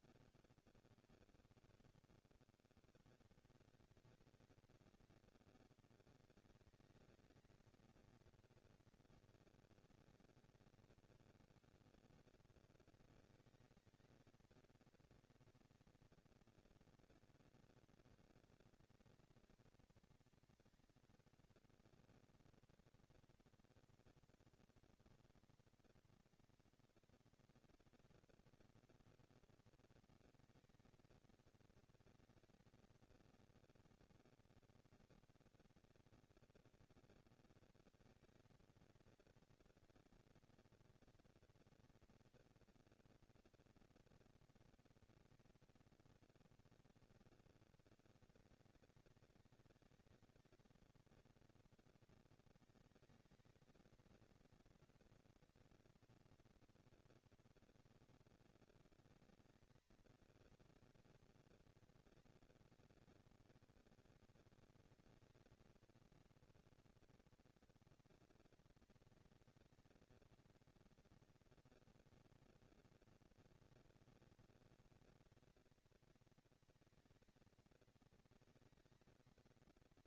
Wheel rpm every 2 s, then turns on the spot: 90, 120, 210, 210, 230, 150, 210, 230, 240, 230, 230, 230, 230, 220, 230, 230, 230, 230, 230, 230, 230, 230, 230, 200, 190, 210, 220, 230, 240, 220, 230, 230, 230, 240, 230, 230, 230, 230, 230, 220.
none